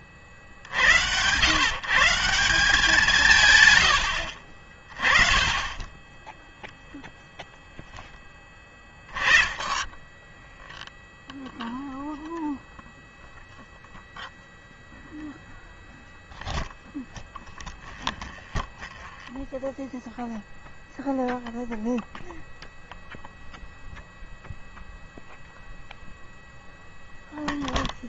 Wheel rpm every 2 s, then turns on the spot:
60, 170, 40, 0, 10, 10, 0, 0, 0, 10, 0, 0, 0, 0.
18-20